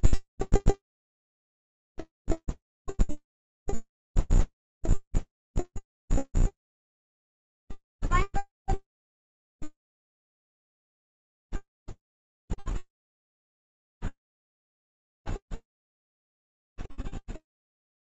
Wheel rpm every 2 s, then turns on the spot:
0, 0, 0, 0, 0, 0, 0, 0, 0.
none